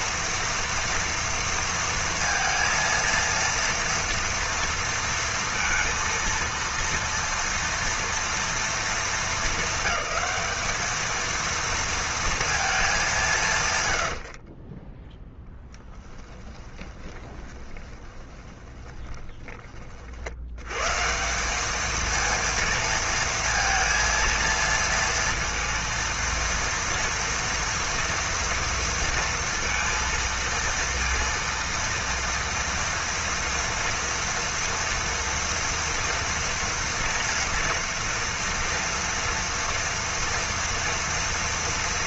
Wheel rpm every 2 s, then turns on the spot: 230, 230, 230, 230, 220, 210, 220, 30, 20, 20, 100, 230, 230, 230, 230, 230, 230, 230, 230, 230, 240.
14-20